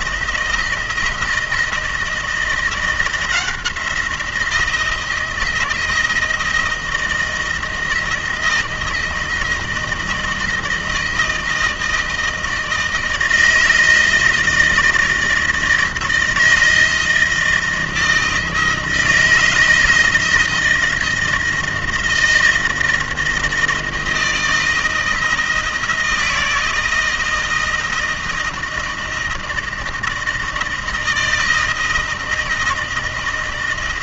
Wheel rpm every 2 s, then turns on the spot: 160, 170, 170, 160, 160, 160, 160, 160, 160, 160, 160, 160, 160, 160, 160, 160, 160.
none